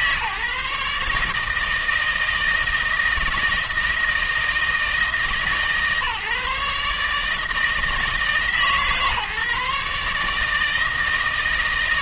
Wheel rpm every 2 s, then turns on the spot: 140, 160, 160, 140, 150, 160.
none